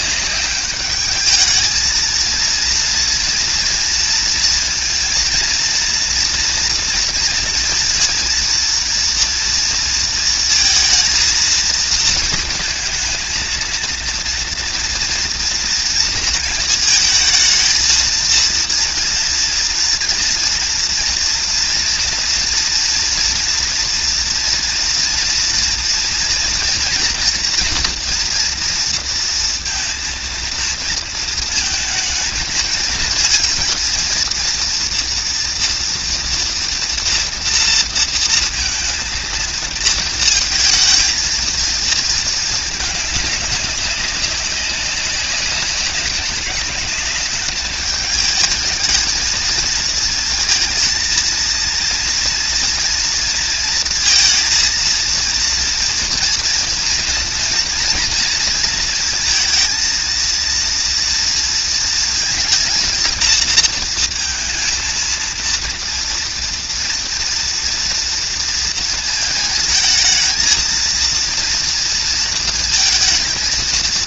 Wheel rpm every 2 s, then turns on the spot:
200, 230, 230, 230, 230, 230, 220, 230, 230, 230, 230, 230, 230, 230, 230, 230, 220, 230, 240, 230, 230, 220, 190, 200, 220, 220, 230, 230, 230, 230, 230, 230, 220, 230, 230, 230, 230.
none